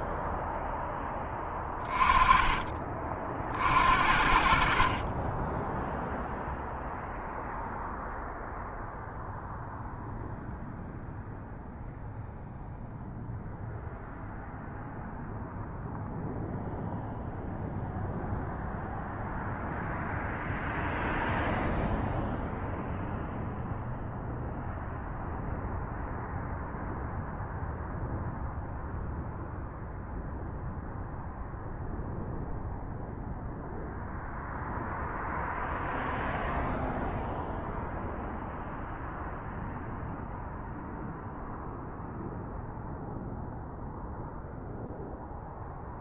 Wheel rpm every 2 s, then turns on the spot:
0, 20, 60, 0, 0, 0, 0, 0, 0, 0, 0, 0, 0, 0, 0, 0, 0, 0, 0, 0, 0, 0, 0.
4-6